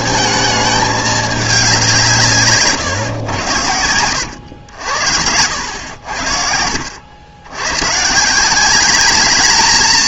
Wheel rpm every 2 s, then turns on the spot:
220, 140, 90, 70, 170.
none